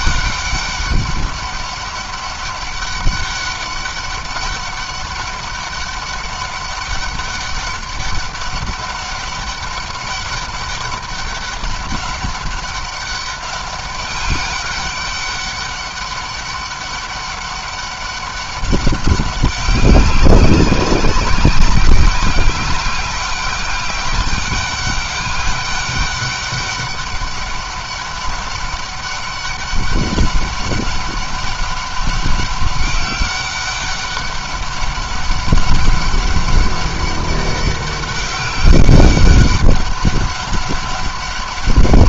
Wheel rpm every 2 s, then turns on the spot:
200, 200, 200, 200, 200, 200, 200, 200, 200, 190, 190, 190, 200, 200, 200, 190, 200, 190, 200, 200, 200.
none